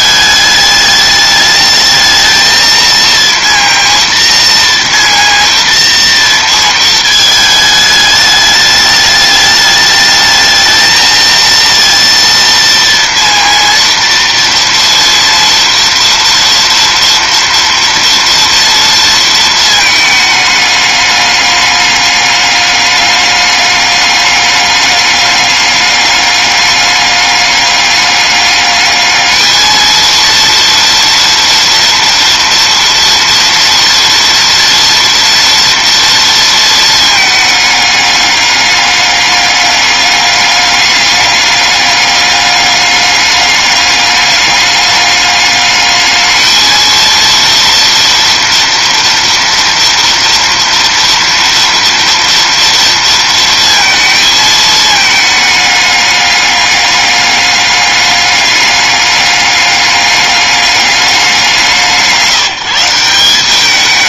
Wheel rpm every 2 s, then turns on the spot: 210, 230, 230, 220, 210, 220, 230, 230, 230, 230, 210, 200, 200, 200, 210, 230, 230, 230, 220, 200, 200, 200, 200, 230, 230, 230, 230, 210, 200, 200, 200, 180.
none